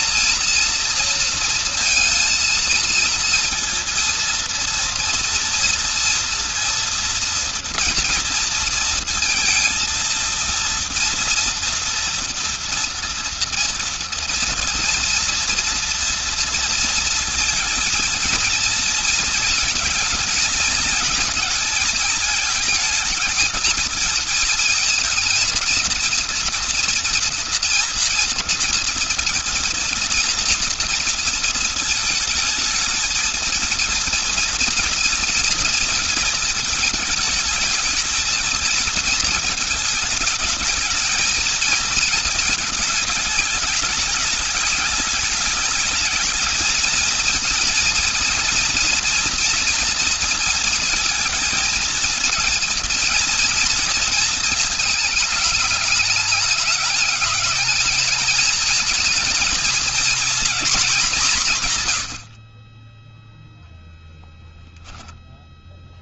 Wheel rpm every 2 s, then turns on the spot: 230, 230, 230, 230, 230, 230, 230, 230, 230, 220, 220, 220, 220, 230, 230, 230, 220, 230, 220, 230, 220, 220, 210, 220, 230, 230, 230, 230, 210, 220, 240, 60, 0.
none